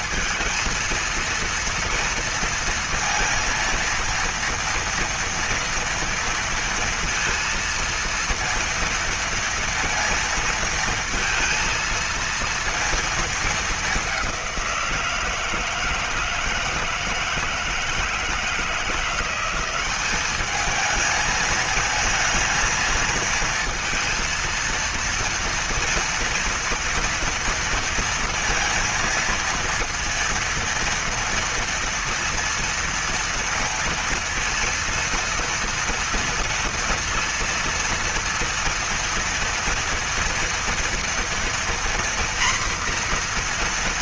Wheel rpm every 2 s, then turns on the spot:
230, 230, 230, 230, 230, 230, 230, 180, 160, 170, 210, 230, 230, 230, 230, 230, 230, 230, 230, 230, 230, 240.
none